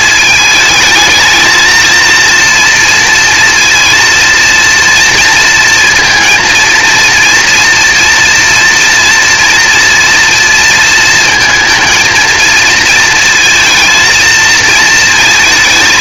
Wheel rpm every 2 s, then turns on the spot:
220, 230, 230, 230, 230, 230, 230, 220.
none